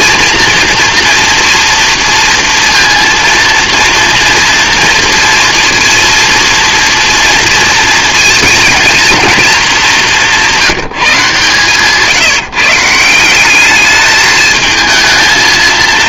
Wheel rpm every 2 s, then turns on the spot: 230, 230, 230, 230, 220, 170, 150, 220.
none